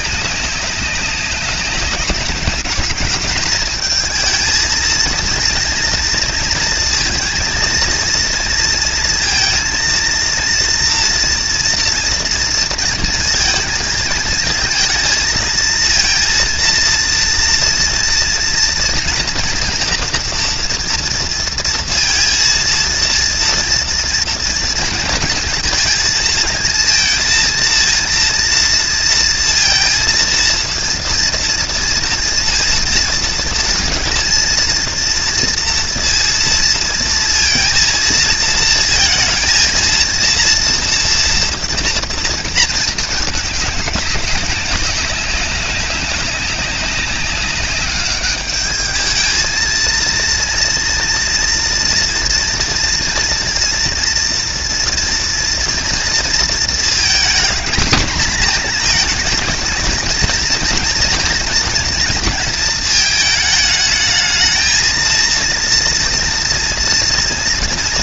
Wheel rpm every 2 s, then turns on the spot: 190, 190, 230, 230, 230, 230, 230, 220, 230, 240, 240, 230, 230, 220, 230, 230, 230, 230, 230, 230, 230, 220, 190, 190, 210, 230, 240, 230, 230, 230, 230, 230, 220, 230.
none